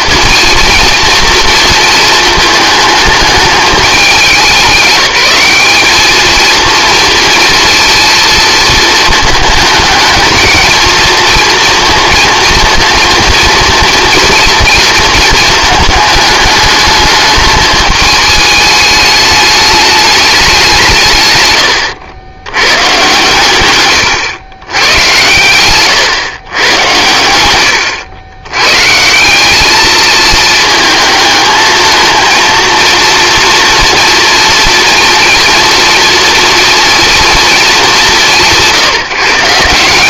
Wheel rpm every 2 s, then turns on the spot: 230, 220, 190, 230, 230, 220, 230, 230, 210, 210, 190, 120, 110, 110, 120, 220, 230, 230, 230, 170.
none